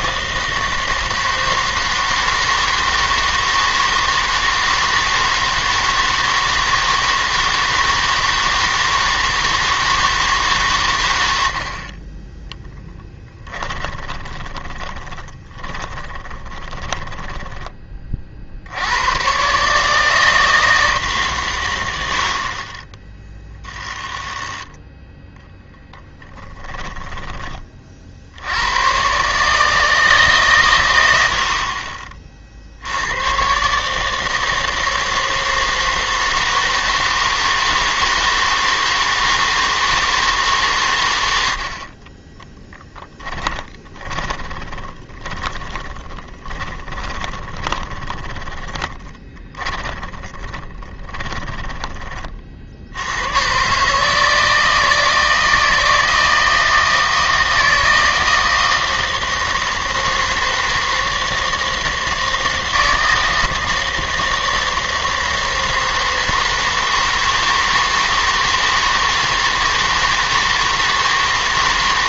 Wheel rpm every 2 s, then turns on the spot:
160, 160, 160, 160, 160, 130, 10, 20, 10, 80, 160, 30, 10, 10, 100, 120, 70, 160, 160, 160, 130, 10, 20, 20, 20, 20, 50, 160, 160, 160, 160, 160, 160, 160, 160, 160.
14-18 26-28 42-52